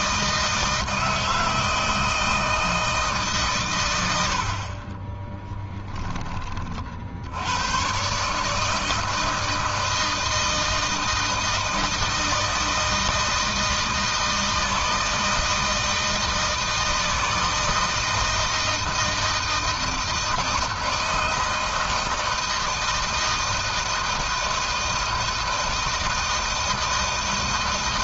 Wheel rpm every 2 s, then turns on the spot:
160, 160, 60, 30, 150, 160, 160, 160, 160, 160, 160, 160, 160, 160.
4-6